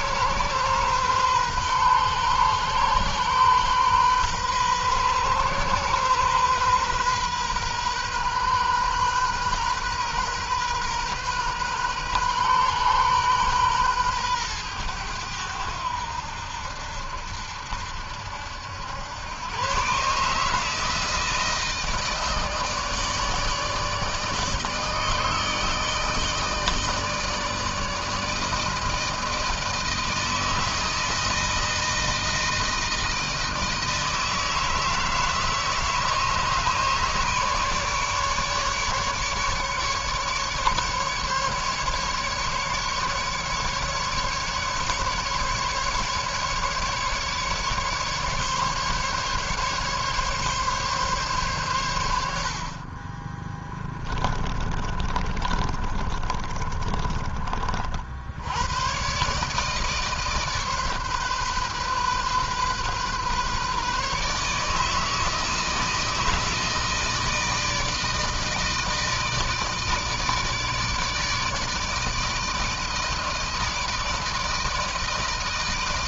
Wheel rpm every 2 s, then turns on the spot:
130, 130, 130, 130, 130, 130, 130, 110, 80, 90, 160, 160, 160, 160, 160, 160, 160, 160, 150, 150, 140, 150, 140, 150, 140, 140, 40, 30, 30, 110, 140, 130, 160, 160, 160, 150, 160, 160.
52-58